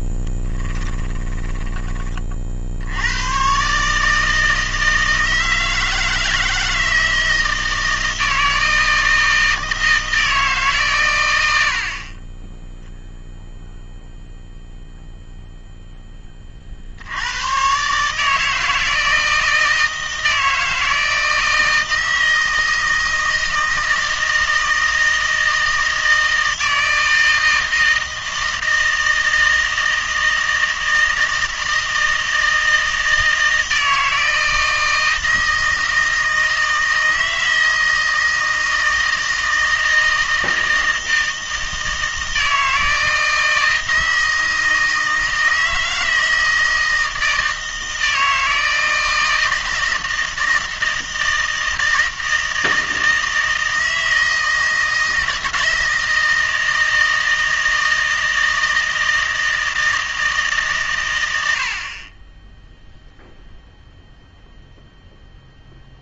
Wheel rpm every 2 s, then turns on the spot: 0, 30, 150, 160, 160, 160, 50, 0, 20, 150, 160, 160, 160, 160, 160, 160, 160, 160, 160, 160, 160, 160, 160, 160, 160, 160, 160, 160, 160, 160, 140, 0, 0.
none